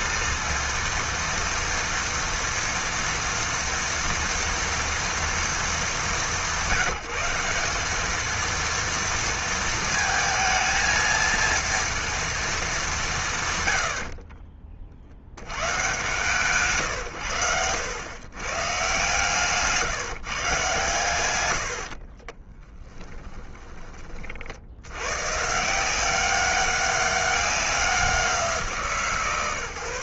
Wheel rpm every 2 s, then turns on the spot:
230, 230, 230, 170, 230, 220, 200, 40, 140, 140, 140, 10, 90, 200, 160.
22-24